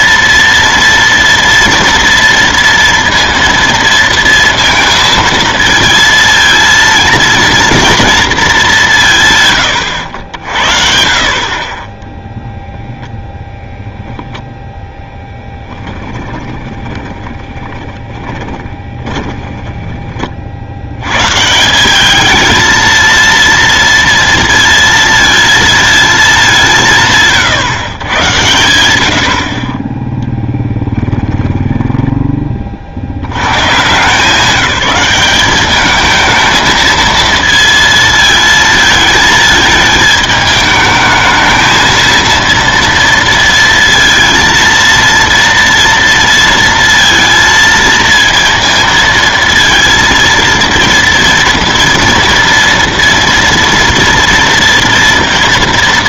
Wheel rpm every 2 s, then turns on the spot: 230, 230, 230, 230, 210, 70, 0, 10, 20, 20, 50, 220, 230, 190, 110, 10, 30, 190, 220, 220, 210, 230, 230, 230, 230, 230, 230, 230.
16-20